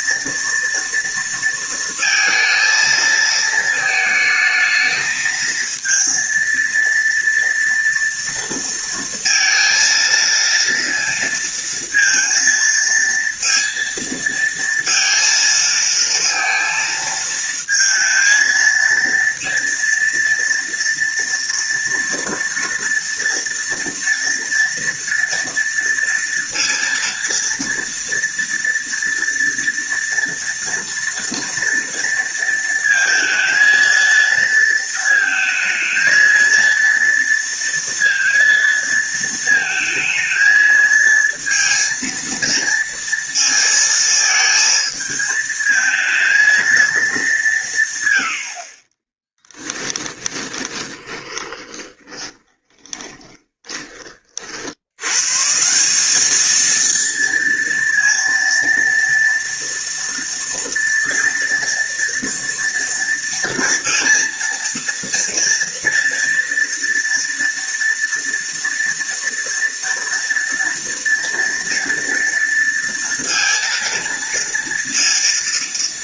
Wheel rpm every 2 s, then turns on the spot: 230, 230, 220, 230, 230, 230, 230, 230, 230, 220, 230, 230, 230, 230, 230, 230, 230, 230, 230, 230, 220, 230, 220, 230, 80, 20, 10, 40, 210, 230, 230, 230, 230, 230, 230, 230, 230, 230.
50-54